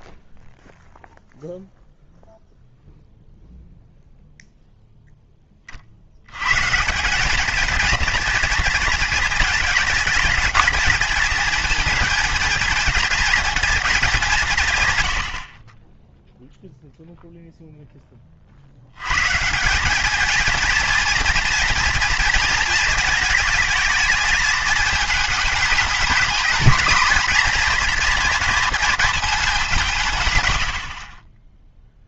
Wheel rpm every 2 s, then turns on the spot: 0, 0, 0, 130, 230, 220, 230, 160, 0, 60, 230, 230, 220, 230, 230, 70.
none